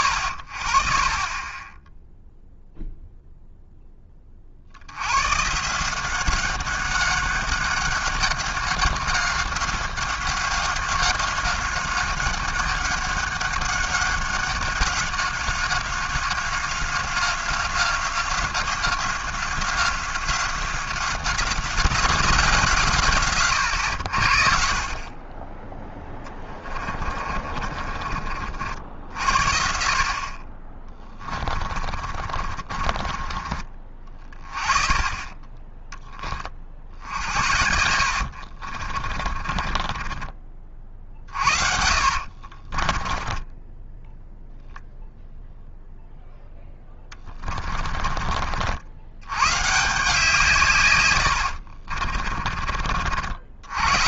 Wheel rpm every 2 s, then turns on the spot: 70, 0, 80, 190, 190, 190, 190, 190, 190, 180, 180, 140, 40, 30, 60, 20, 30, 20, 70, 40, 50, 30, 0, 20, 100, 110, 50.
26-28 30-32 36-44 46-48